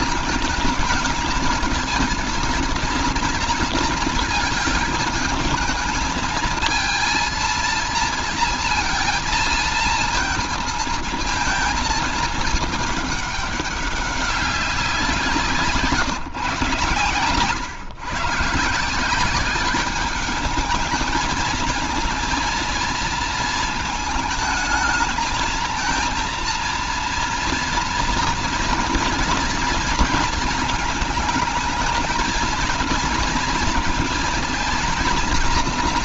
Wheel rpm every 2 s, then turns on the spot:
220, 220, 220, 220, 230, 230, 210, 190, 130, 150, 210, 230, 220, 230, 230, 230, 230, 230.
none